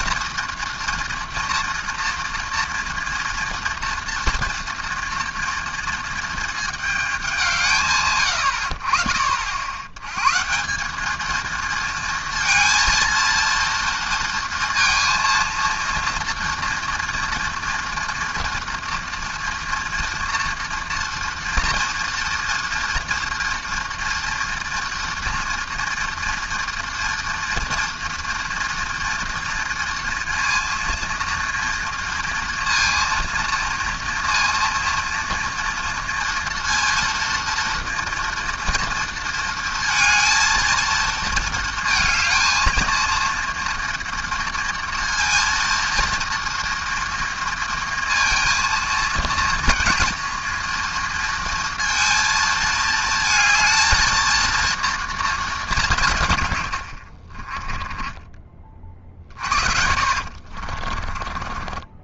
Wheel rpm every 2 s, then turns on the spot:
240, 230, 230, 220, 70, 160, 230, 230, 230, 230, 230, 240, 230, 230, 240, 230, 230, 230, 230, 230, 230, 220, 230, 230, 230, 230, 220, 230, 110, 30, 40.
56-58 60-62